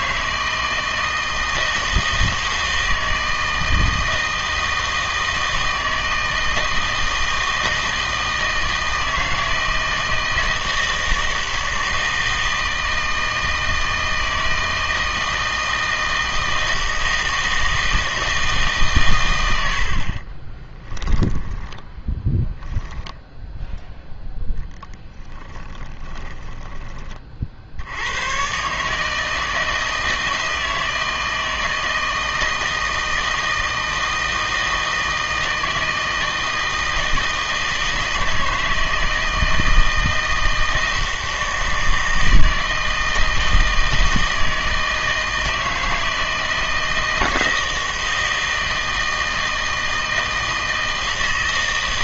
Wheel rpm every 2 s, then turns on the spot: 160, 160, 160, 160, 160, 160, 160, 160, 160, 150, 20, 10, 10, 20, 130, 160, 160, 160, 160, 160, 160, 160, 160, 160, 160, 160.
20-22